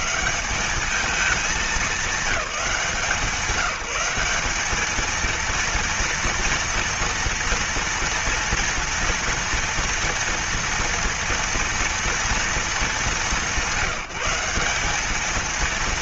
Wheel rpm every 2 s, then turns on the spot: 210, 180, 220, 230, 230, 230, 200, 210.
none